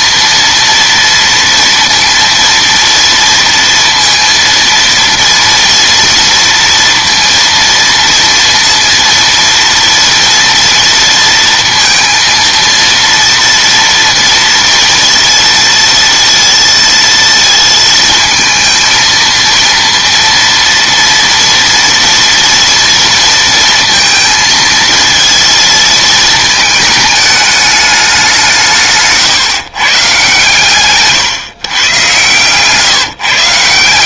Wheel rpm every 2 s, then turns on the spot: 230, 230, 230, 230, 230, 230, 230, 230, 230, 220, 230, 230, 230, 220, 160, 130, 140.
30-32